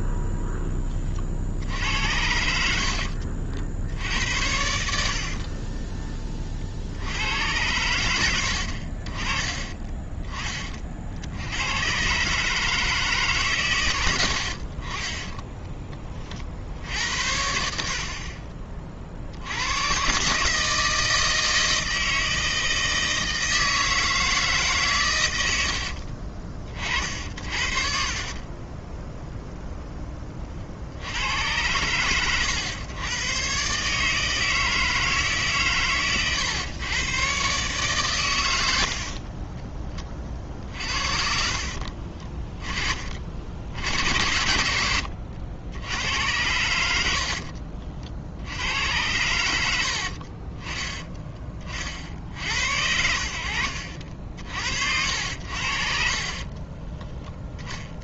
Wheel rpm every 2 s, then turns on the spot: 10, 70, 80, 50, 70, 40, 150, 50, 50, 30, 150, 160, 150, 50, 20, 50, 100, 160, 120, 100, 40, 20, 70, 90, 80, 30, 70, 60, 30.
2-4 40-42 56-58